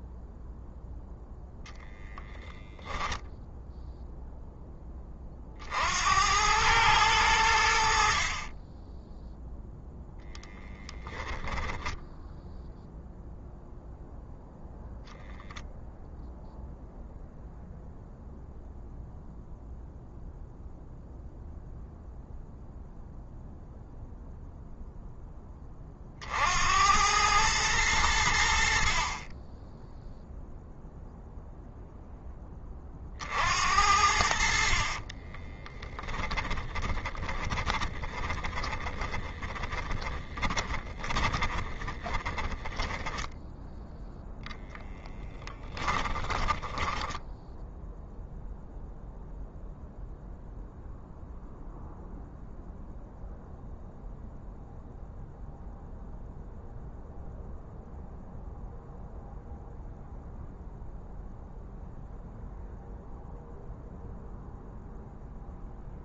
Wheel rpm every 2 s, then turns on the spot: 0, 0, 20, 100, 10, 10, 0, 0, 0, 0, 0, 0, 0, 90, 40, 0, 40, 40, 20, 20, 20, 10, 10, 10, 0, 0, 0, 0, 0, 0, 0, 0, 0.
10-12 34-42 44-48